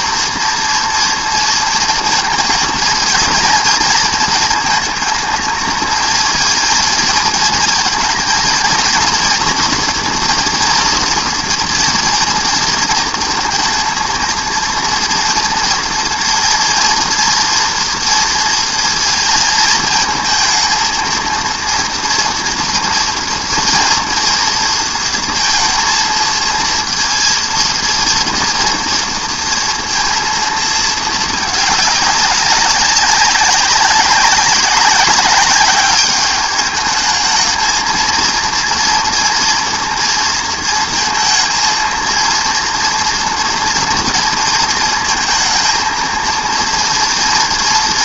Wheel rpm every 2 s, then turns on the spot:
230, 230, 230, 230, 230, 230, 230, 230, 230, 230, 220, 230, 230, 230, 230, 230, 190, 200, 210, 230, 230, 230, 230, 230.
none